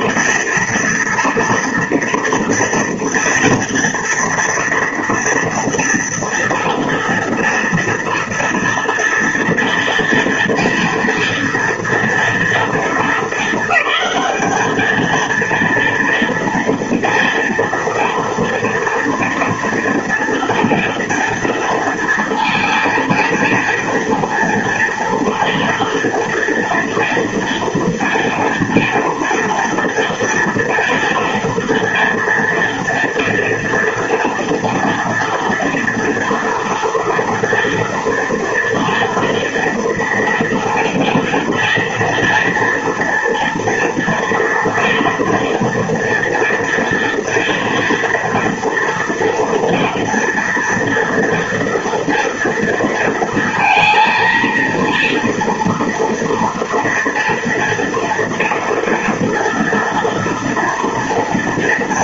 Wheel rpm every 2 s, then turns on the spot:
230, 230, 230, 230, 230, 230, 230, 210, 230, 230, 230, 230, 230, 230, 230, 240, 230, 240, 230, 230, 230, 230, 240, 230, 230, 230, 230, 230, 230, 230, 230.
none